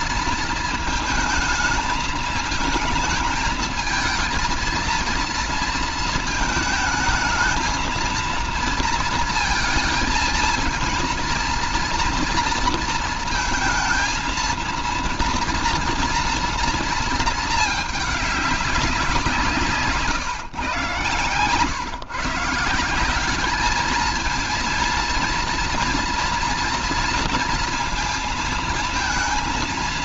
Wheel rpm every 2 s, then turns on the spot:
220, 220, 220, 220, 230, 230, 230, 230, 230, 210, 140, 160, 230, 230, 230.
none